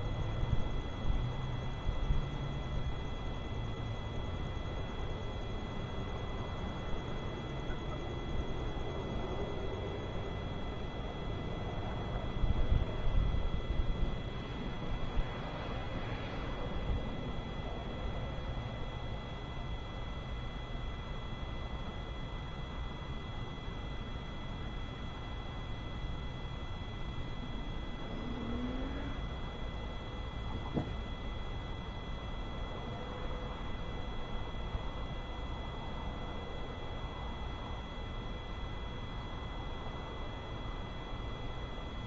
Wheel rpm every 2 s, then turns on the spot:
0, 0, 0, 0, 0, 0, 0, 0, 0, 0, 0, 0, 0, 0, 0, 0, 0, 0, 0, 0, 0.
none